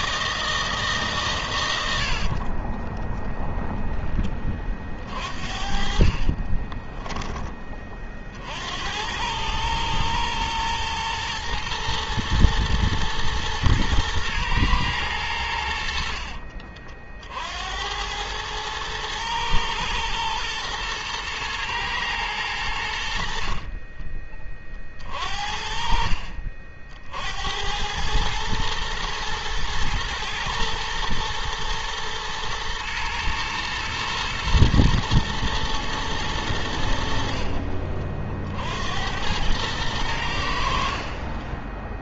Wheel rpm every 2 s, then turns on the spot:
160, 30, 30, 20, 70, 110, 120, 110, 40, 110, 110, 90, 30, 50, 110, 120, 110, 120, 90, 70, 60.
2-4 6-8